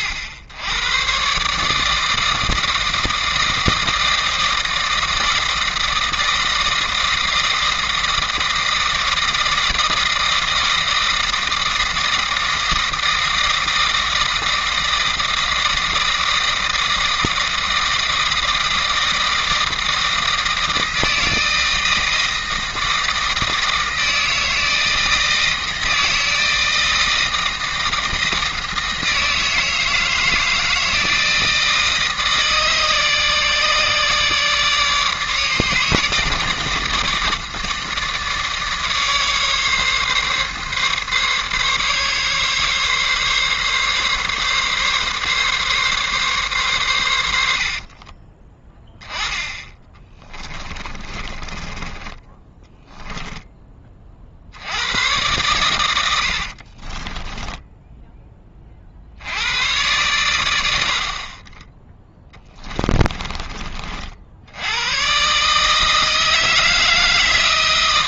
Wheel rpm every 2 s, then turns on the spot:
100, 160, 160, 160, 160, 160, 160, 160, 160, 160, 160, 160, 160, 160, 160, 160, 150, 150, 150, 150, 140, 140, 140, 120, 10, 20, 10, 80, 40, 30, 60, 20, 90, 160.
50-54 56-58 62-64